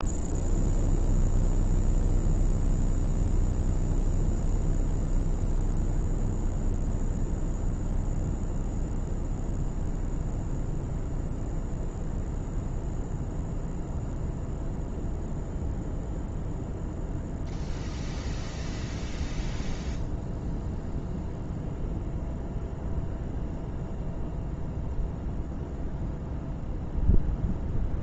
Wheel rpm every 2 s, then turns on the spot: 0, 0, 0, 0, 0, 0, 0, 0, 0, 0, 0, 0, 0, 0.
none